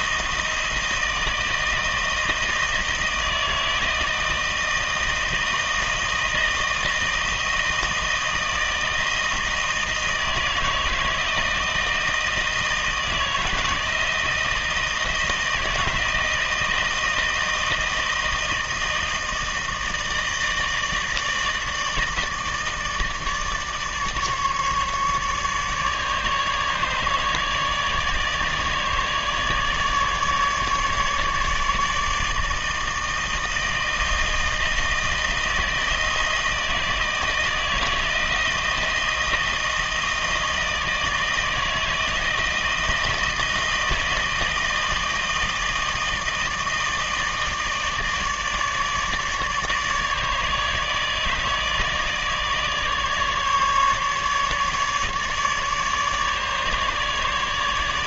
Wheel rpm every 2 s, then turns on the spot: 160, 160, 160, 160, 160, 160, 160, 160, 160, 160, 160, 160, 150, 150, 150, 150, 160, 160, 160, 160, 160, 160, 160, 160, 150, 160, 150, 150, 150.
none